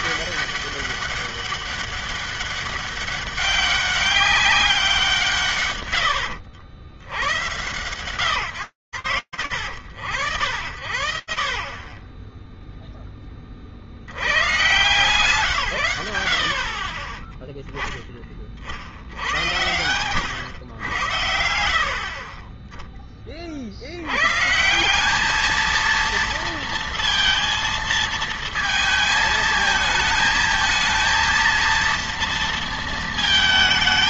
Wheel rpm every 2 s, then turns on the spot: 200, 200, 200, 90, 100, 60, 20, 140, 20, 80, 90, 10, 180, 230, 220, 230, 230.
16-18